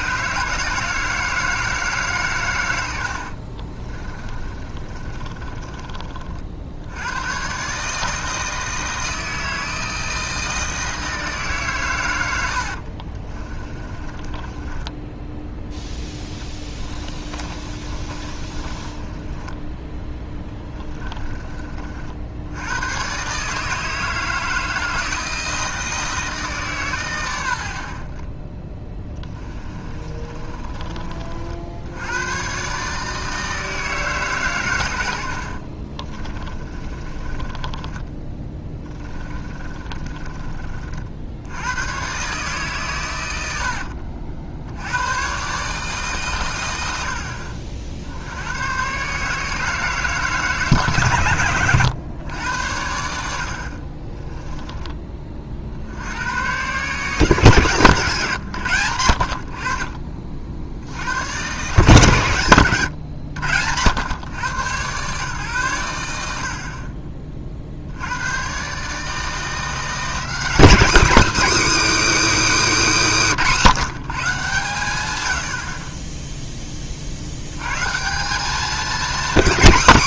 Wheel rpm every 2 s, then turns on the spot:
160, 110, 20, 50, 160, 160, 70, 20, 20, 30, 20, 90, 160, 140, 20, 30, 130, 120, 30, 20, 40, 140, 60, 110, 110, 150, 90, 20, 120, 110, 60, 130, 120, 60, 130, 240, 290, 130, 10, 210.
4-6 12-22 30-32 36-40 54-56